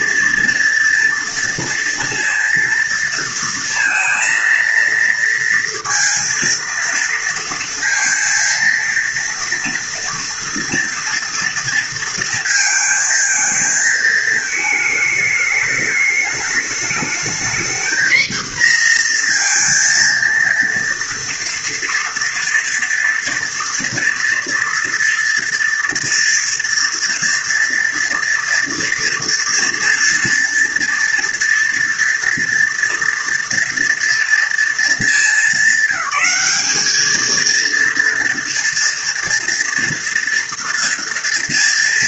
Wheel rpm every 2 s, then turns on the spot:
230, 230, 230, 230, 230, 230, 220, 220, 220, 240, 230, 230, 230, 230, 230, 230, 230, 210, 210, 230, 230.
none